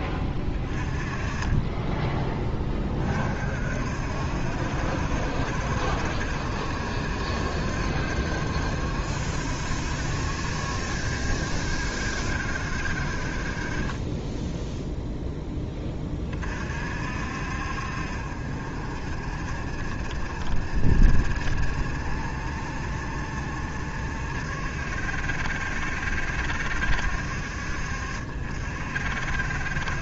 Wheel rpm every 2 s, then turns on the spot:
20, 20, 60, 60, 60, 60, 60, 0, 50, 50, 40, 50, 60, 70, 50.
none